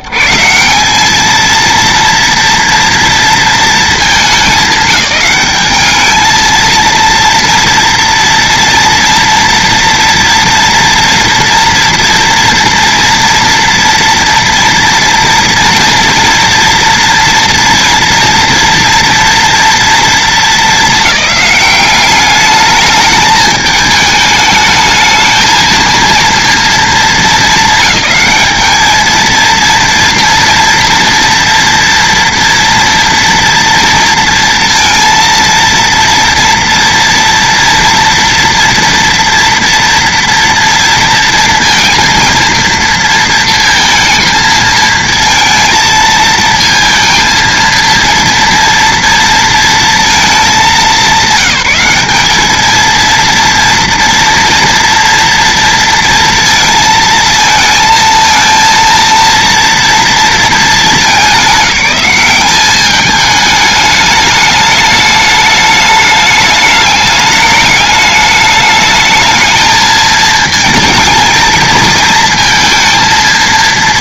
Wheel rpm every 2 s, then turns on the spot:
140, 230, 210, 230, 230, 240, 230, 230, 230, 230, 210, 210, 220, 230, 220, 240, 230, 230, 240, 230, 230, 230, 230, 220, 230, 200, 220, 230, 230, 230, 220, 200, 210, 210, 210, 220, 230.
none